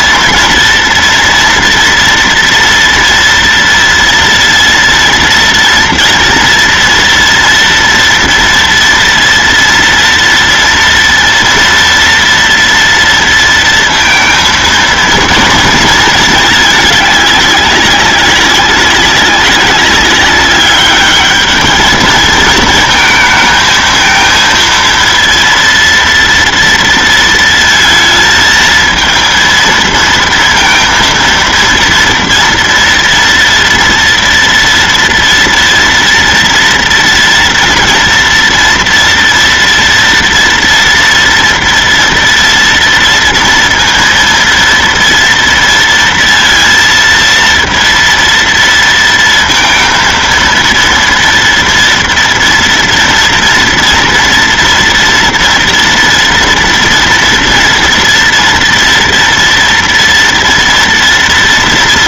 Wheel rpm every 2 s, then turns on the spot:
230, 230, 230, 240, 230, 230, 230, 230, 210, 200, 210, 220, 230, 230, 230, 230, 230, 230, 230, 230, 230, 230, 230, 230, 230, 230, 230, 230, 230, 230, 230.
none